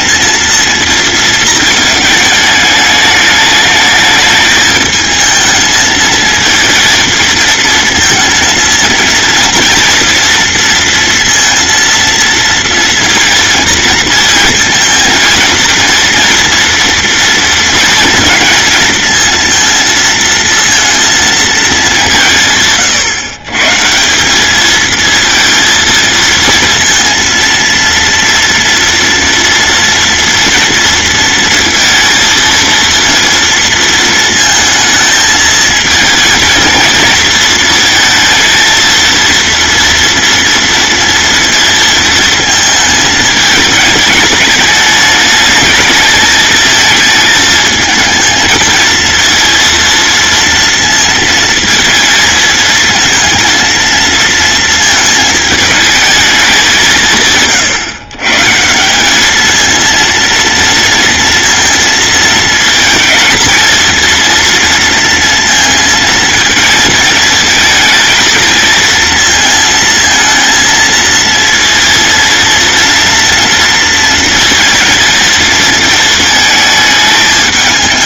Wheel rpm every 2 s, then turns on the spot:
230, 210, 220, 220, 230, 230, 230, 230, 230, 230, 230, 140, 220, 230, 230, 230, 230, 220, 230, 230, 230, 220, 210, 220, 230, 230, 220, 220, 170, 170, 230, 220, 230, 220, 230, 220, 230, 230, 220.
none